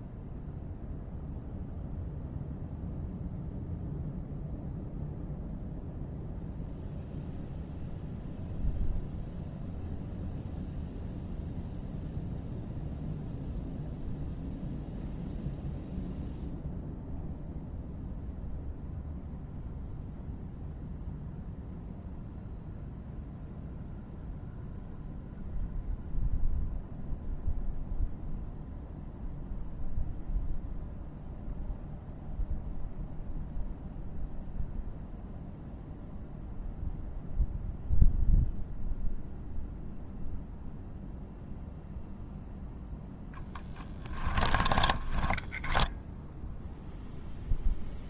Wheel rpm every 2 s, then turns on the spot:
0, 0, 0, 0, 0, 0, 0, 0, 0, 0, 0, 0, 0, 0, 0, 0, 0, 0, 0, 0, 0, 0, 10, 0.
44-46